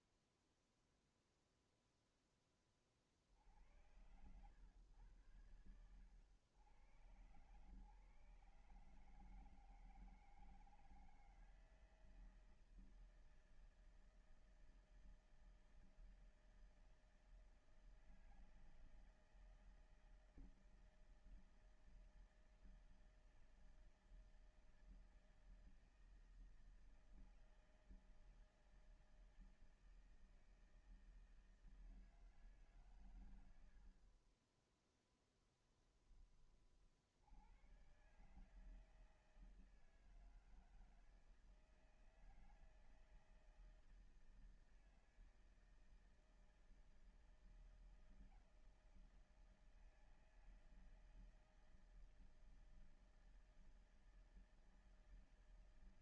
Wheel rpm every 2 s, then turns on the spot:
0, 10, 110, 110, 140, 160, 160, 160, 160, 160, 160, 160, 160, 160, 160, 160, 160, 50, 20, 140, 160, 160, 160, 160, 160, 160, 160, 160.
none